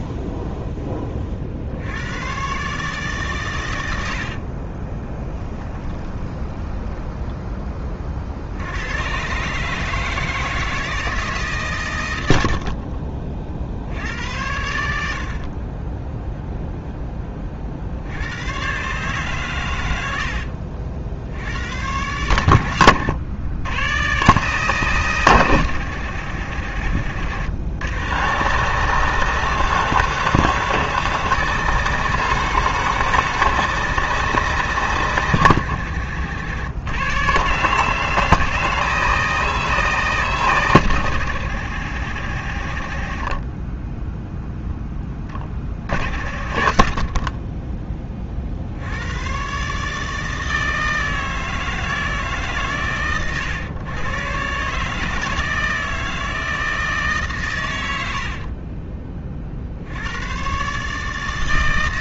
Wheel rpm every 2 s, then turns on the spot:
10, 140, 30, 10, 90, 160, 60, 80, 0, 130, 60, 100, 150, 80, 150, 160, 160, 150, 120, 160, 130, 60, 10, 50, 70, 160, 130, 140, 160, 30, 140.
4-8 12-14 58-60